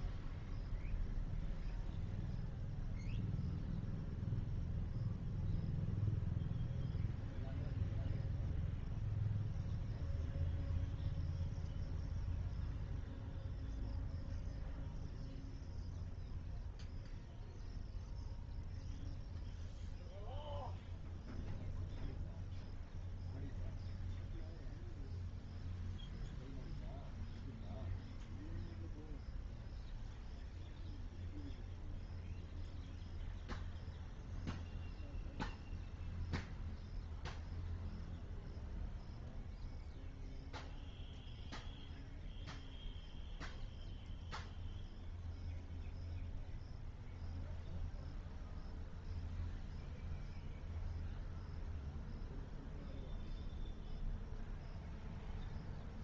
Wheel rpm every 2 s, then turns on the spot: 0, 0, 0, 0, 0, 0, 0, 0, 0, 0, 0, 0, 0, 0, 0, 0, 0, 0, 0, 0, 0, 0, 0, 0, 0, 0, 0, 0.
none